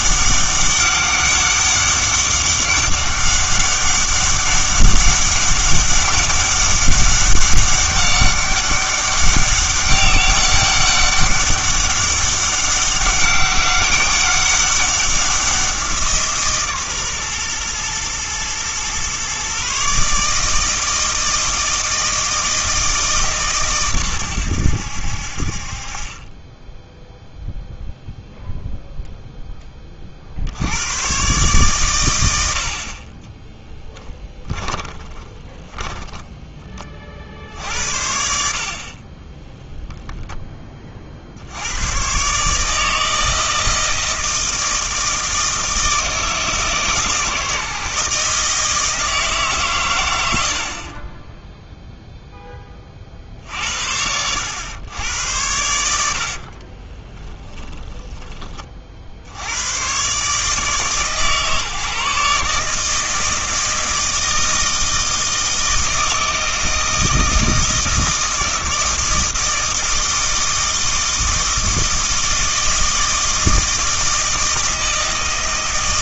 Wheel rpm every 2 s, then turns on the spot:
200, 200, 200, 190, 200, 200, 190, 200, 140, 120, 160, 160, 90, 10, 0, 80, 60, 10, 20, 60, 30, 150, 160, 160, 160, 50, 30, 100, 40, 30, 150, 150, 160, 160, 160, 160, 160, 160.
34-36 56-58